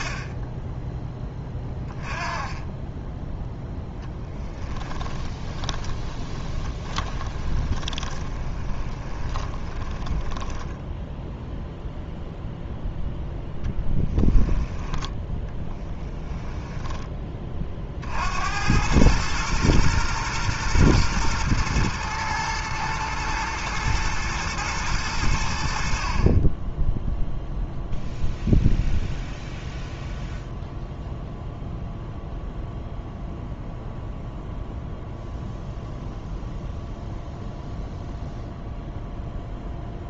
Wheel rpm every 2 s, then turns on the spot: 20, 10, 20, 30, 20, 20, 0, 10, 10, 90, 120, 110, 110, 20, 0, 0, 0, 0, 0, 0.
2-12 16-18